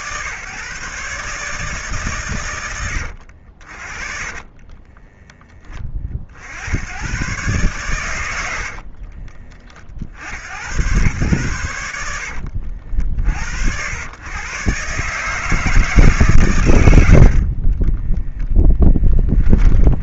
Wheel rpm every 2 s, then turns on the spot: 130, 120, 30, 80, 70, 100, 60, 130, 120, 10.
4-6 8-10 18-20